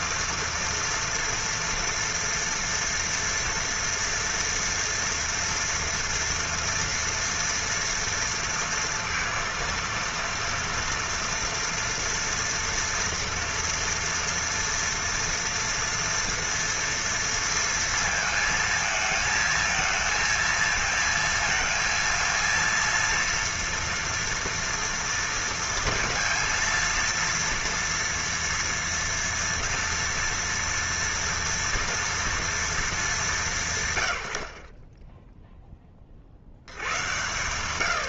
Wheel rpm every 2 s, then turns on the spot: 230, 230, 230, 230, 230, 230, 230, 230, 230, 220, 230, 230, 240, 230, 230, 230, 220, 70, 70.
none